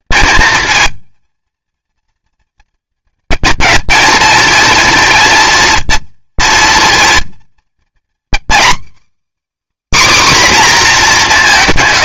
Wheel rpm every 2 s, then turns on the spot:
220, 230, 240, 230, 280, 240.
none